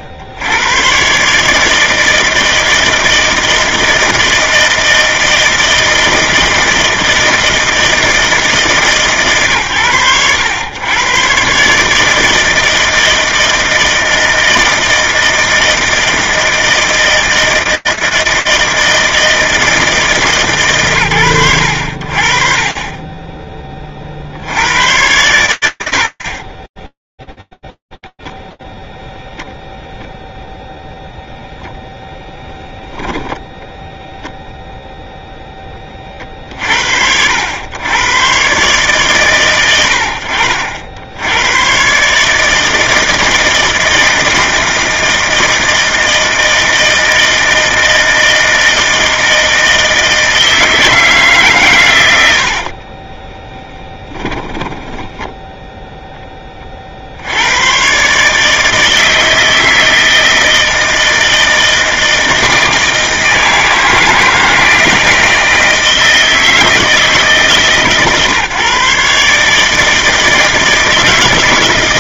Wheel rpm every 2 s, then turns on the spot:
90, 160, 160, 160, 150, 100, 160, 160, 160, 160, 130, 30, 110, 10, 0, 0, 0, 10, 100, 110, 110, 160, 160, 160, 160, 130, 10, 0, 110, 160, 160, 160, 160, 140, 150, 160.
26-28 52-54